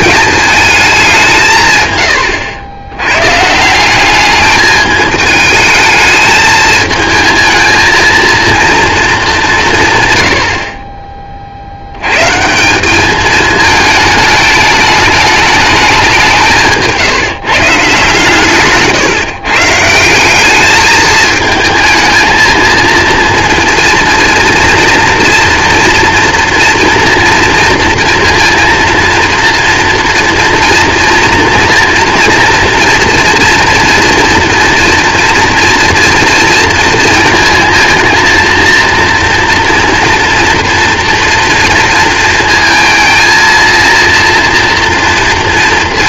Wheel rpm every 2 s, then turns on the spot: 210, 100, 210, 220, 230, 60, 170, 210, 160, 130, 210, 230, 230, 230, 230, 230, 230, 240, 230, 230, 240, 230, 240.
none